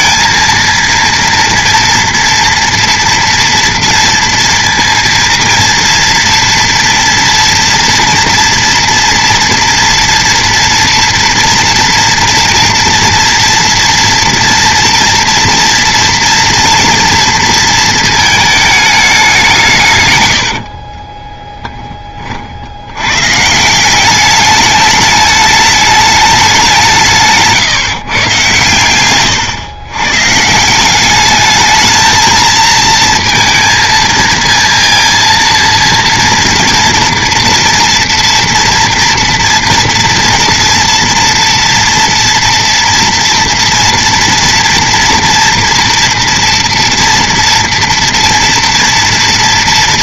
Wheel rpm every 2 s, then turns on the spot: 230, 240, 230, 240, 230, 240, 230, 230, 230, 220, 60, 70, 210, 180, 120, 160, 230, 230, 230, 230, 230, 230, 230, 230, 230.
20-22